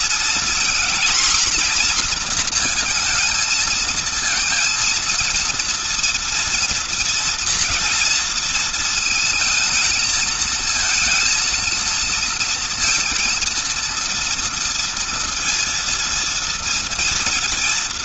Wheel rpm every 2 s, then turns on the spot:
240, 230, 230, 230, 230, 230, 230, 230, 230.
none